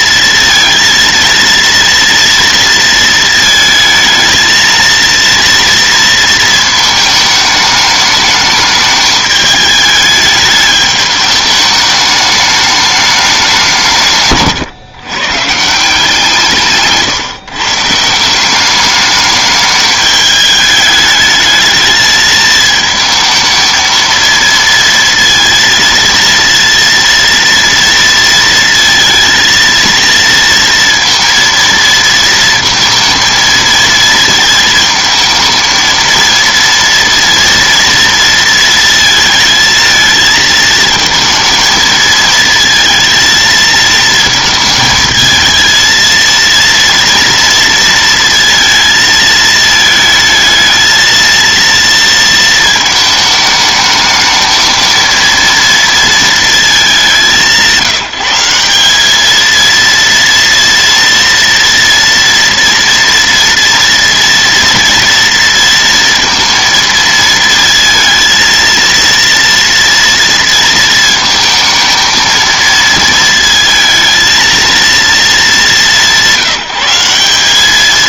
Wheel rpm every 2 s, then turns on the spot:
230, 230, 220, 230, 210, 210, 210, 130, 150, 200, 210, 220, 230, 230, 230, 230, 230, 220, 230, 230, 220, 220, 220, 230, 230, 220, 220, 220, 220, 180, 230, 230, 230, 230, 230, 230, 230, 230, 180.
16-18